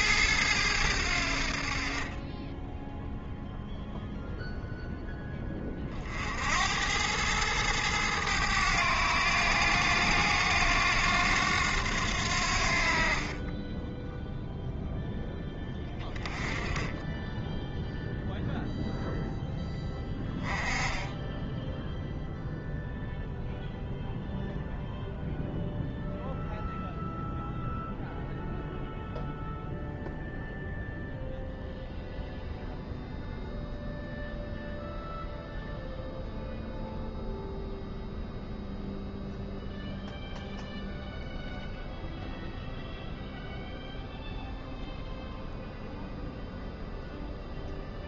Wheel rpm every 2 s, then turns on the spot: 100, 10, 0, 80, 100, 90, 70, 0, 20, 0, 10, 0, 0, 0, 0, 0, 0, 0, 0, 0, 0, 0, 0, 0.
none